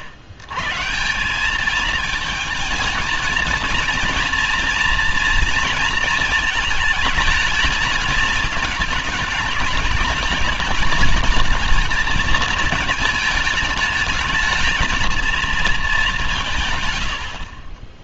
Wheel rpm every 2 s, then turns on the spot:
130, 220, 230, 220, 210, 210, 220, 220, 150.
none